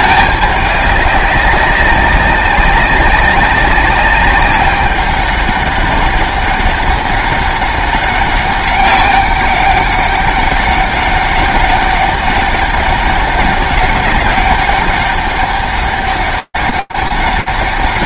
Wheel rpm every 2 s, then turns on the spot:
200, 190, 200, 200, 190, 190, 200, 190, 200.
none